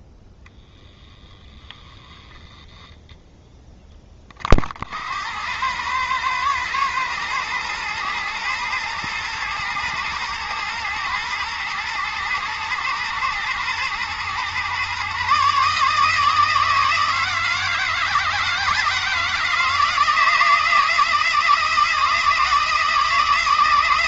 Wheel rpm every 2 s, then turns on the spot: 0, 0, 60, 110, 110, 110, 110, 130, 160, 160, 160, 160.
none